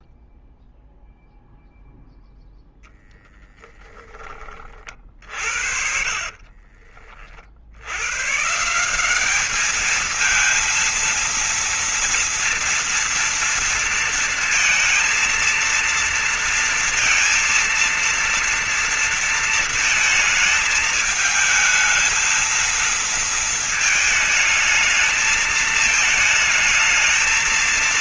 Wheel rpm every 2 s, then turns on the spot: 0, 0, 10, 40, 120, 220, 230, 230, 230, 230, 220, 220, 220, 220.
6-8